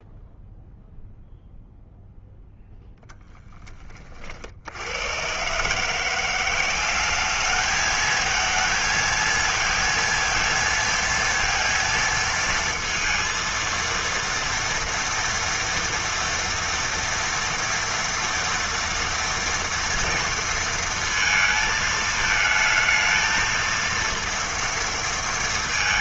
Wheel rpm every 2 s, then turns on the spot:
0, 10, 70, 180, 220, 220, 230, 230, 230, 230, 230, 220, 230.
none